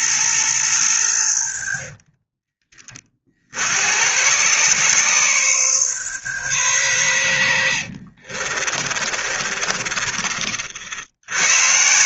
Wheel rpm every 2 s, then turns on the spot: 110, 20, 130, 130, 40, 60.
8-10